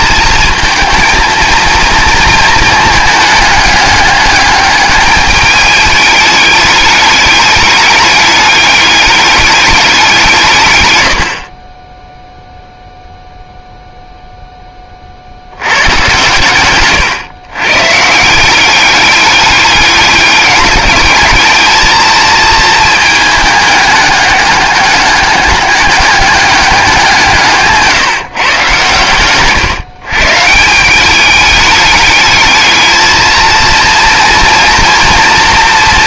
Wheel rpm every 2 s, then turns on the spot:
230, 220, 210, 210, 200, 130, 0, 20, 130, 190, 200, 220, 200, 200, 120, 180, 220, 230.
none